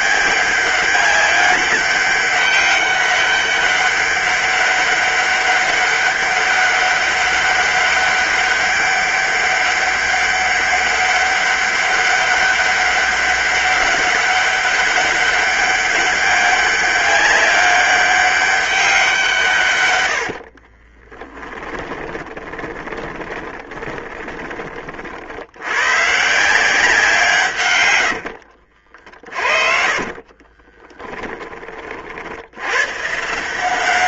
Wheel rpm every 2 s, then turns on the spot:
200, 190, 200, 200, 200, 200, 200, 200, 200, 180, 20, 20, 50, 170, 50, 10, 130.
20-24 28-32